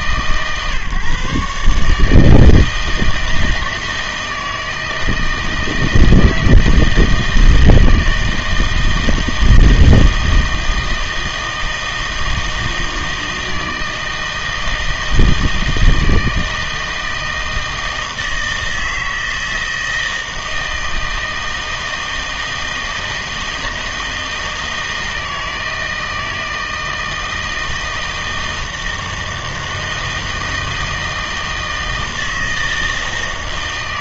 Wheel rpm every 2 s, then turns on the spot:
140, 160, 160, 160, 160, 160, 160, 160, 160, 160, 160, 160, 160, 160, 160, 160, 160.
none